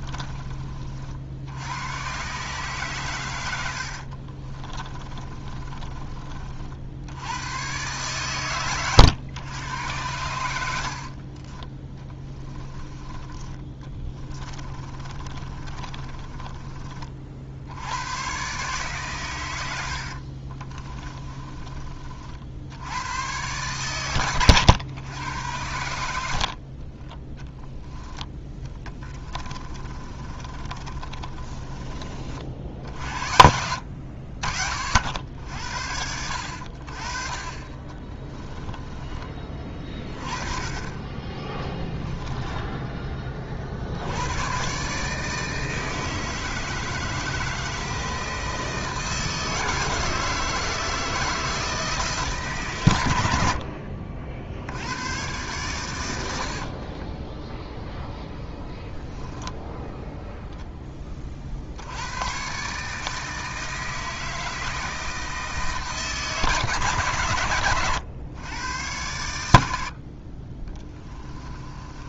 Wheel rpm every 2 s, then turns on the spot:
50, 130, 20, 60, 120, 70, 10, 20, 30, 140, 30, 90, 110, 40, 10, 30, 70, 60, 50, 20, 20, 10, 130, 160, 160, 160, 120, 90, 40, 10, 10, 140, 160, 130, 110, 20.
4-6 14-16 20-22 28-32 38-42 56-58 70-72